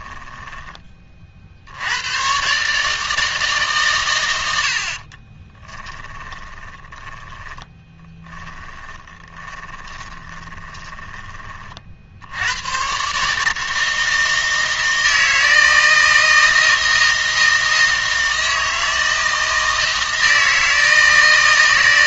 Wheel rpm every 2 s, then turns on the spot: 30, 140, 80, 30, 30, 20, 110, 160, 160, 160, 160.
6-12